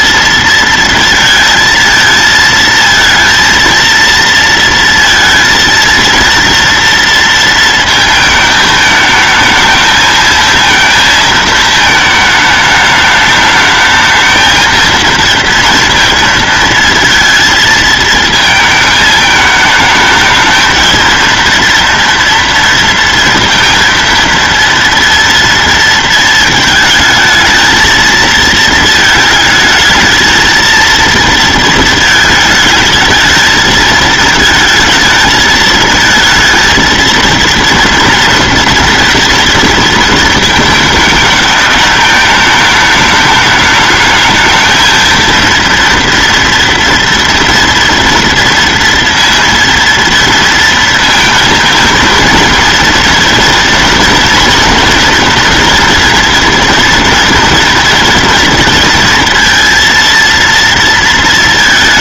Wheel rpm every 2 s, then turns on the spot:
230, 220, 230, 230, 220, 230, 210, 220, 230, 220, 220, 230, 230, 230, 220, 230, 220, 220, 230, 230, 220, 210, 220, 230, 230, 230, 230, 230, 240, 230, 230.
none